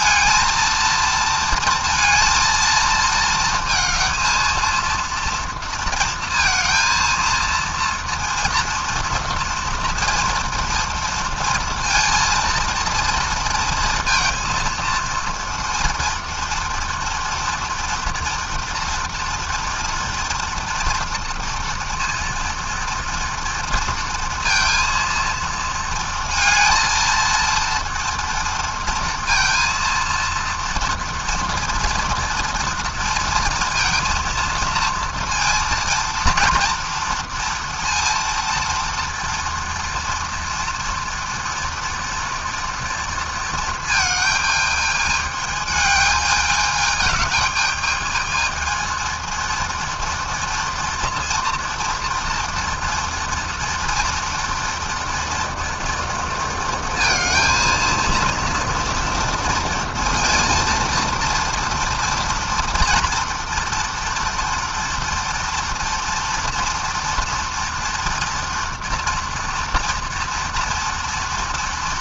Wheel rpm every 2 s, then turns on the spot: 230, 230, 230, 230, 230, 230, 230, 230, 230, 240, 230, 230, 230, 230, 230, 230, 230, 230, 230, 230, 230, 230, 220, 210, 230, 230, 230, 230, 230, 230, 230, 240, 230, 230, 230, 230.
none